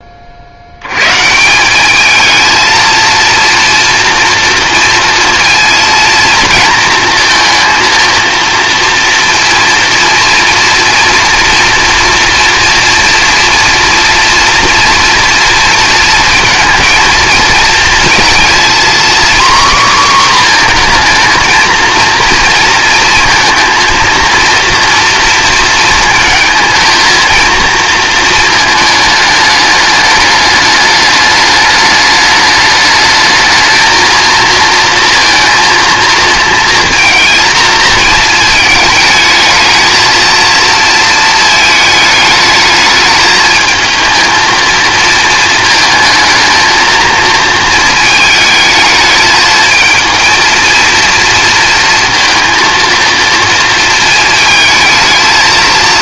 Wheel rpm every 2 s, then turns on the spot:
90, 220, 230, 230, 230, 230, 230, 230, 230, 240, 240, 230, 230, 230, 220, 210, 210, 230, 230, 220, 230, 220, 220, 220, 220, 230, 230, 220.
none